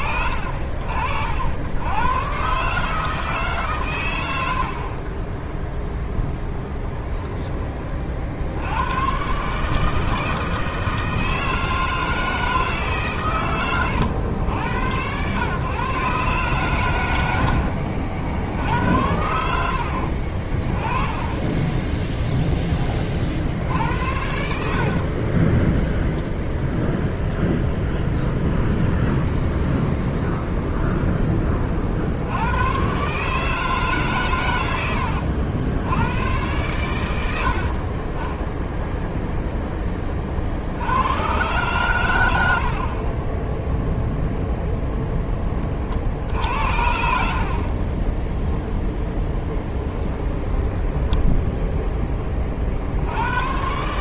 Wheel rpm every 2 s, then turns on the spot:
50, 140, 60, 30, 80, 160, 160, 90, 120, 70, 30, 10, 60, 10, 10, 20, 110, 100, 100, 0, 70, 60, 0, 70, 10, 10, 50.
4-8 24-26 28-32 46-48 50-52